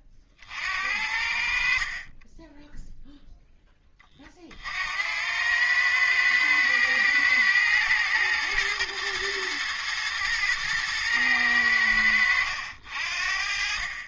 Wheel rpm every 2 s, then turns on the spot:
50, 10, 50, 110, 120, 120, 70.
none